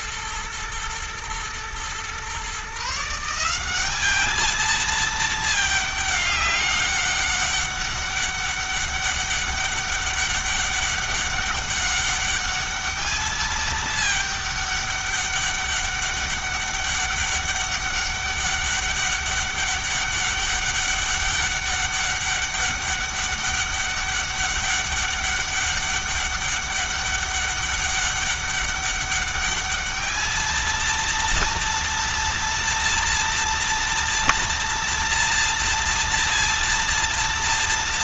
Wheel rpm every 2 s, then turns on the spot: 110, 150, 220, 200, 200, 200, 210, 210, 200, 200, 200, 200, 200, 200, 200, 220, 230, 230, 230.
none